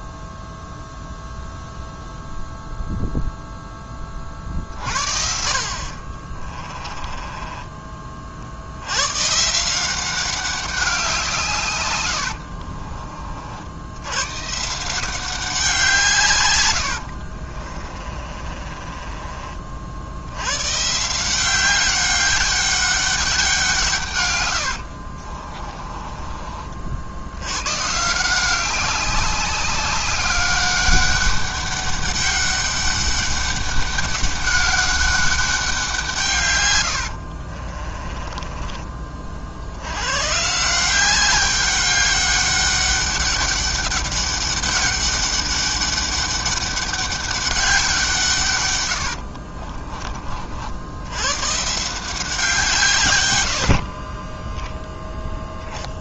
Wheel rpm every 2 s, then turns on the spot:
0, 0, 60, 20, 90, 200, 40, 160, 80, 30, 130, 200, 80, 50, 190, 200, 200, 200, 100, 30, 160, 200, 200, 200, 110, 80, 150, 0.
6-8 12-14 16-20 24-26 36-40 48-50